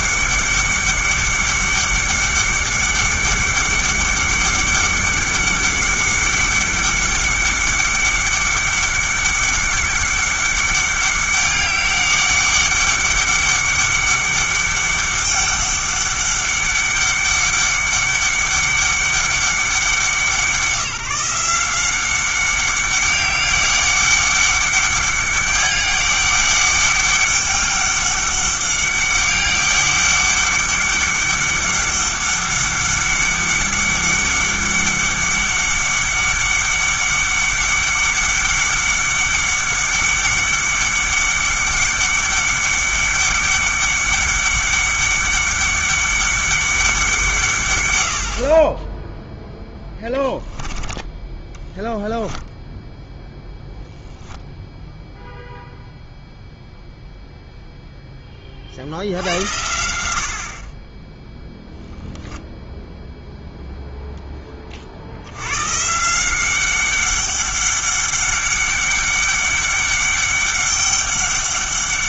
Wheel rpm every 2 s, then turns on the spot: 200, 200, 200, 200, 200, 200, 200, 200, 200, 200, 170, 200, 200, 200, 200, 200, 200, 200, 200, 200, 200, 200, 200, 190, 20, 10, 10, 0, 0, 50, 30, 0, 40, 190, 200, 200.
none